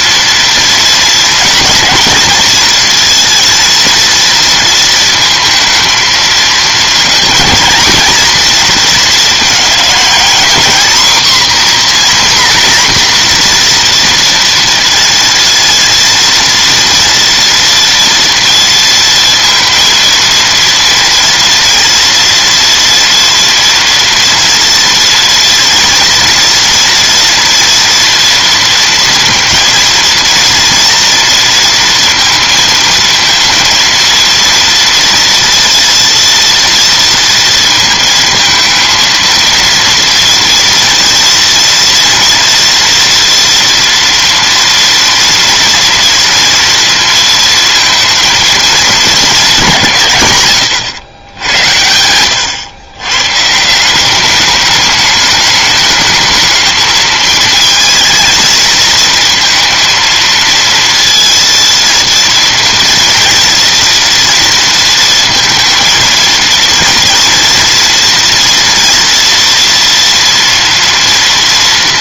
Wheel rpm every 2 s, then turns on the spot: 230, 240, 230, 220, 230, 250, 250, 230, 230, 230, 230, 230, 240, 230, 230, 230, 230, 230, 230, 230, 230, 230, 230, 230, 220, 110, 120, 210, 220, 230, 230, 230, 230, 230, 230, 230.
none